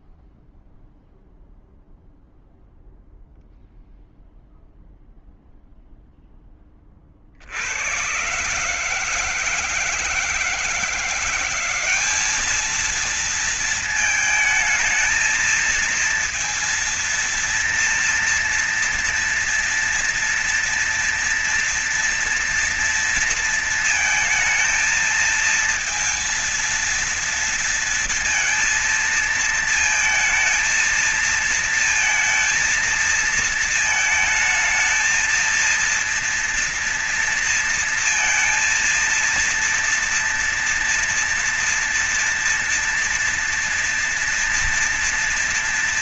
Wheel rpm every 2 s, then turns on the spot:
0, 0, 0, 10, 130, 160, 210, 220, 230, 230, 230, 230, 220, 230, 230, 220, 230, 220, 230, 230, 230, 240, 230.
none